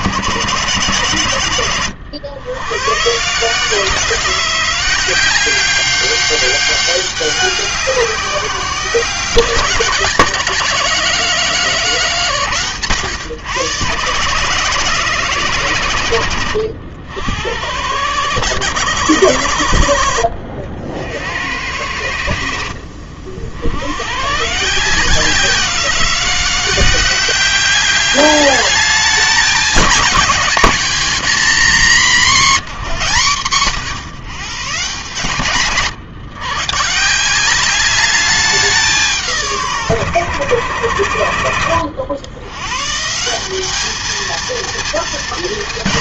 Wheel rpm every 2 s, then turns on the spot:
110, 110, 170, 200, 180, 160, 130, 160, 90, 120, 70, 60, 160, 180, 210, 230, 200, 130, 130, 190, 100, 130, 230.
none